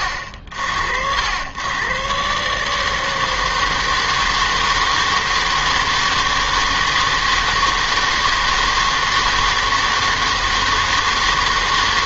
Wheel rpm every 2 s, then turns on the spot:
70, 150, 160, 160, 160, 160.
none